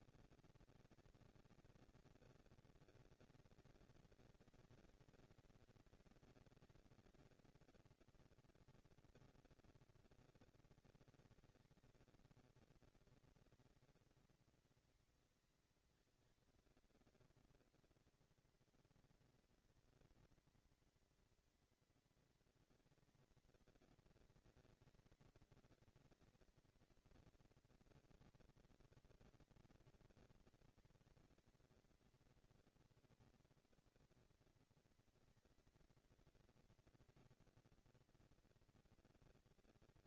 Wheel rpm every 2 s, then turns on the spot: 220, 230, 230, 230, 230, 230, 230, 230, 230, 230, 230, 240, 230, 230, 230, 230, 240, 230, 230, 230.
none